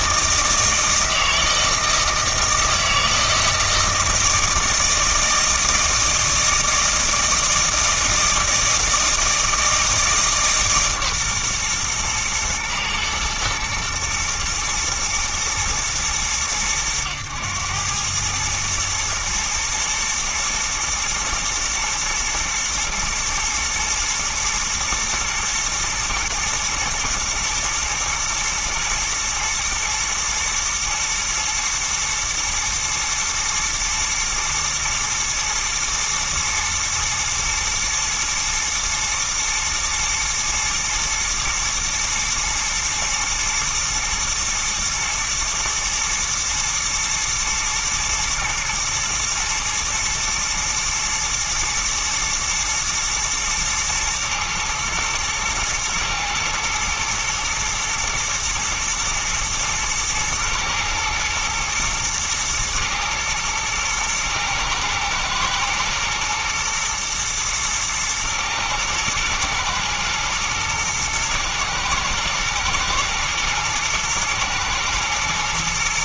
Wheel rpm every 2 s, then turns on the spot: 160, 160, 160, 160, 160, 150, 120, 110, 100, 110, 110, 110, 120, 110, 110, 120, 110, 110, 110, 110, 120, 110, 110, 110, 120, 110, 120, 110, 110, 110, 110, 120, 110, 110, 120, 120, 110, 110.
none